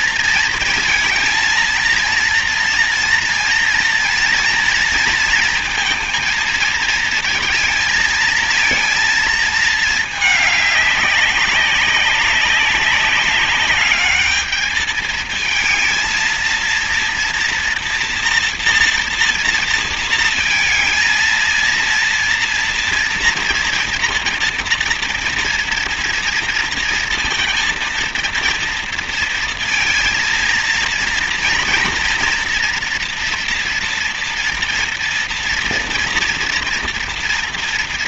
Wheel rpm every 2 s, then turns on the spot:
220, 230, 230, 230, 230, 200, 200, 220, 230, 230, 220, 230, 230, 230, 230, 230, 230, 230, 230.
none